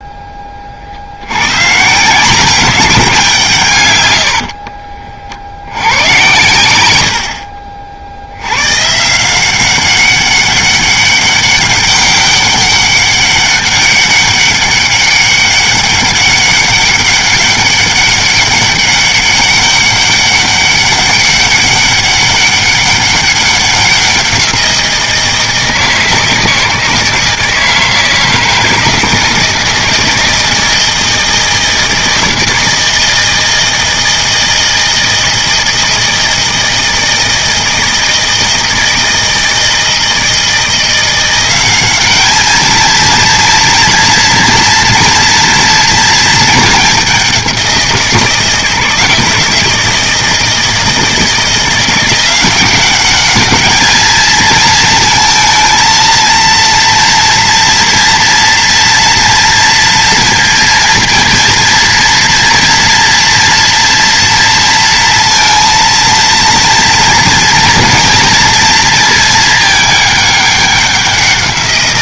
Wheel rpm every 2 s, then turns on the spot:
40, 190, 40, 110, 120, 200, 200, 200, 200, 200, 190, 200, 170, 160, 160, 160, 160, 160, 160, 160, 170, 220, 230, 210, 160, 160, 190, 220, 230, 240, 230, 230, 230, 230, 230, 200.
4-6